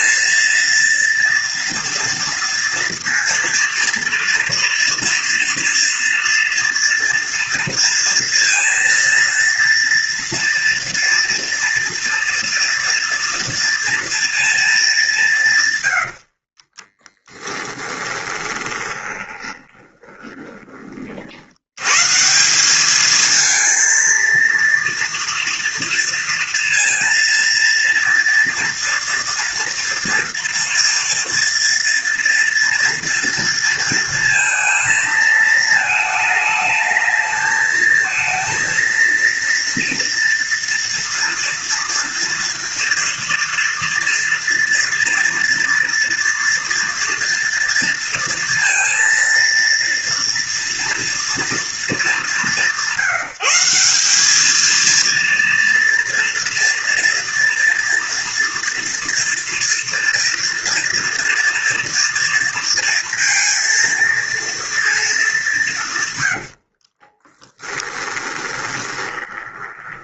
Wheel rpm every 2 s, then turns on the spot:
230, 230, 230, 230, 230, 230, 240, 220, 60, 20, 20, 160, 230, 230, 230, 240, 230, 230, 220, 220, 230, 230, 240, 230, 230, 230, 180, 200, 240, 240, 230, 230, 230, 100, 10.
16-22 66-70